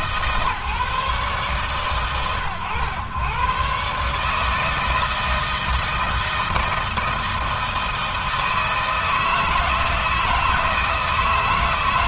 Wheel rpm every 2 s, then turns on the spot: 140, 120, 160, 160, 160, 160.
none